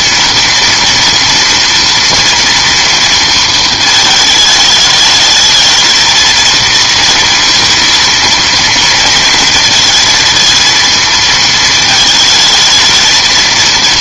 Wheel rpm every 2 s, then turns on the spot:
230, 230, 210, 230, 230, 230, 220.
none